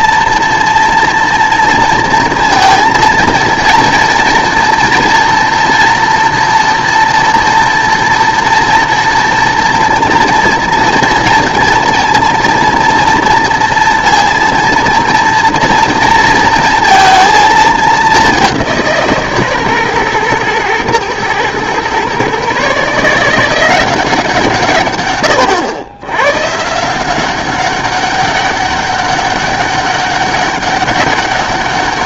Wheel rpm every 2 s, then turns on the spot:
240, 230, 230, 230, 230, 230, 230, 230, 230, 180, 120, 140, 140, 150, 200, 200.
none